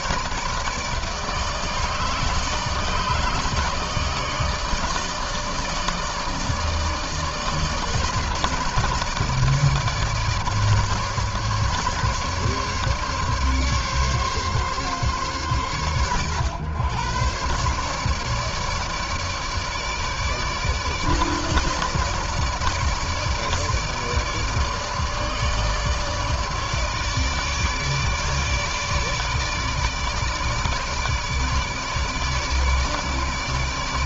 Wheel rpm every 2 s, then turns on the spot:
160, 150, 160, 150, 160, 150, 150, 130, 110, 150, 150, 160, 150, 150, 150, 150, 150.
none